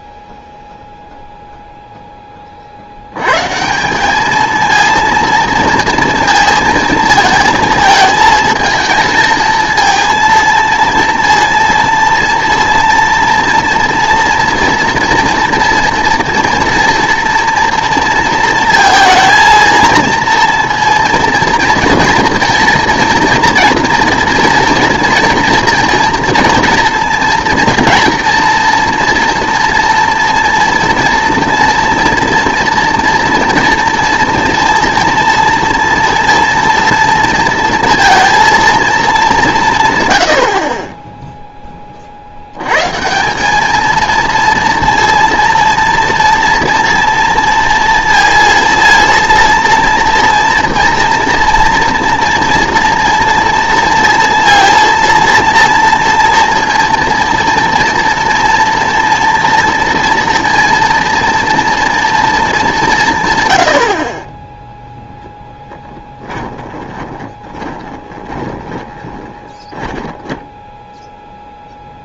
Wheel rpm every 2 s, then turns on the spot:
0, 50, 220, 220, 220, 230, 230, 230, 230, 230, 230, 230, 230, 240, 230, 230, 230, 230, 230, 230, 90, 90, 230, 230, 230, 230, 230, 230, 230, 230, 230, 210, 10, 20, 20, 10.
66-72